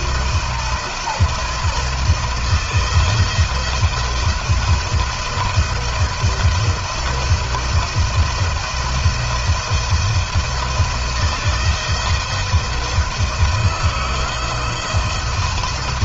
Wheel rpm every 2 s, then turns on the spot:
170, 170, 170, 170, 170, 170, 170, 170.
none